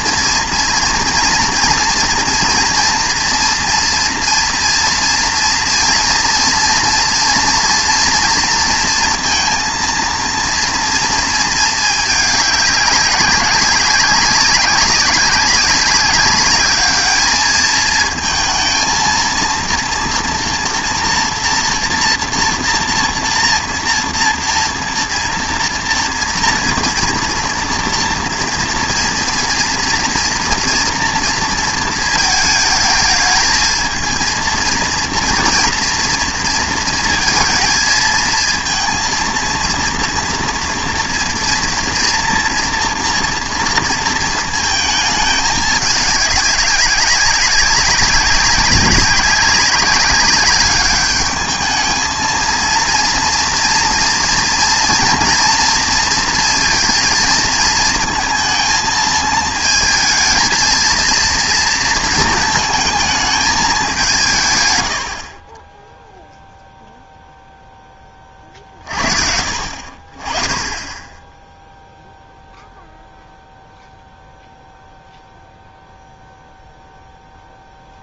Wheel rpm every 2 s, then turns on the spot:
240, 230, 230, 230, 230, 230, 200, 190, 200, 220, 230, 230, 230, 240, 230, 230, 220, 230, 230, 230, 230, 230, 230, 200, 200, 200, 230, 230, 230, 220, 230, 220, 120, 0, 40, 20, 0, 0, 0.
none